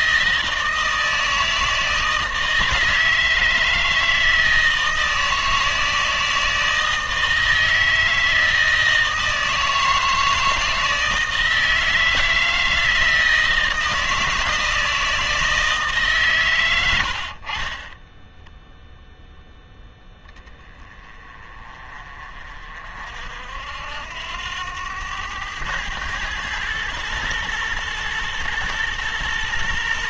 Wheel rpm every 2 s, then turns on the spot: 160, 160, 160, 160, 160, 160, 160, 160, 90, 0, 20, 50, 90, 110, 120.
none